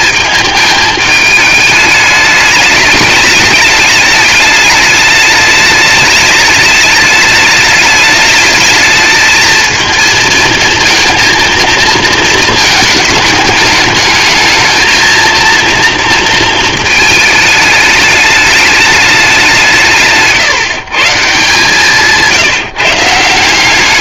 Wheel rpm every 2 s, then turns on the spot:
210, 210, 210, 210, 220, 230, 210, 230, 220, 190, 150, 160.
none